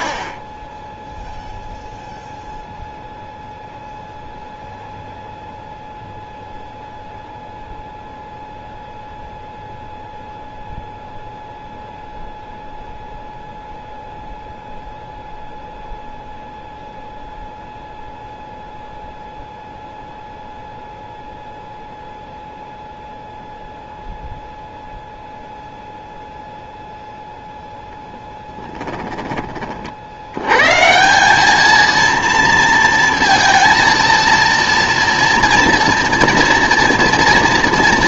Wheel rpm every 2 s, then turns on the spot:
10, 0, 0, 0, 0, 0, 0, 0, 0, 0, 0, 0, 0, 0, 10, 130, 230, 230, 230.
0-2 28-30